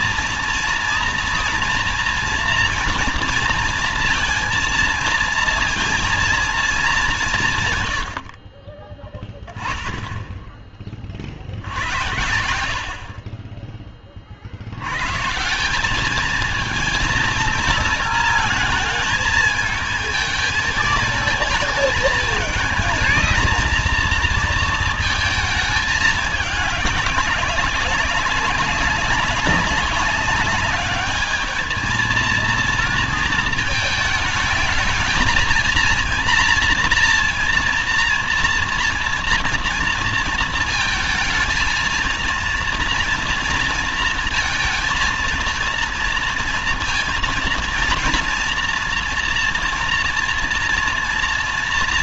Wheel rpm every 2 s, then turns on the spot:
230, 230, 230, 230, 50, 10, 70, 70, 220, 220, 220, 220, 230, 200, 200, 200, 230, 220, 240, 230, 230, 230, 230, 230, 230, 230.
none